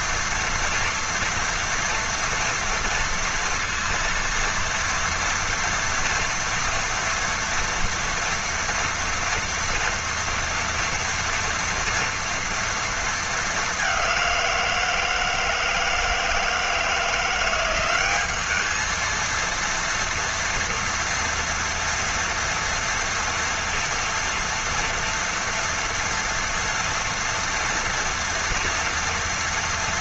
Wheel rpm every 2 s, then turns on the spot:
230, 240, 230, 240, 230, 230, 230, 170, 160, 210, 230, 230, 230, 230, 240.
none